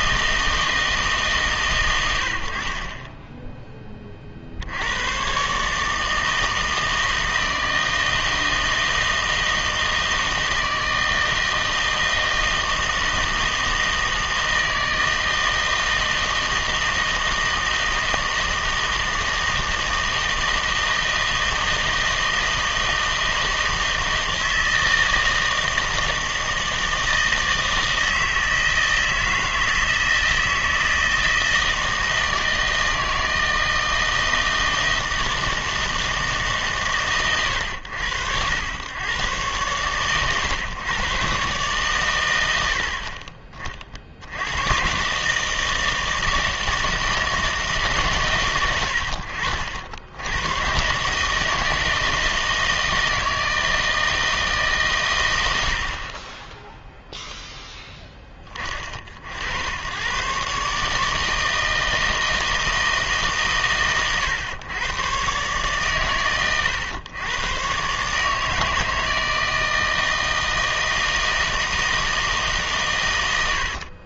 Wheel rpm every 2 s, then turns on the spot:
160, 60, 60, 160, 160, 160, 160, 160, 160, 160, 160, 160, 160, 160, 160, 160, 160, 160, 150, 100, 130, 80, 110, 160, 90, 110, 160, 150, 0, 30, 140, 160, 110, 120, 150, 160, 140.
none